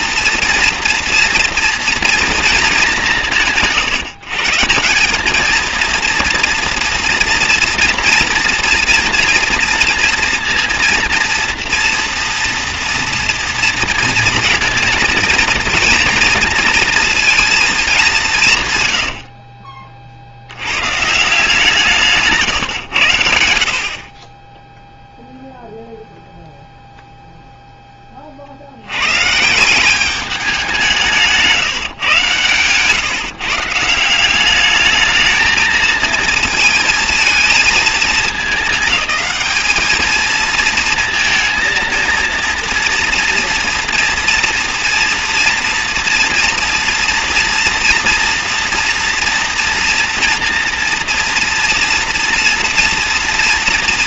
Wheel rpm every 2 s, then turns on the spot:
230, 220, 170, 230, 230, 230, 230, 230, 220, 130, 100, 130, 10, 0, 70, 190, 130, 200, 230, 220, 230, 230, 230, 230, 240, 230, 240.
none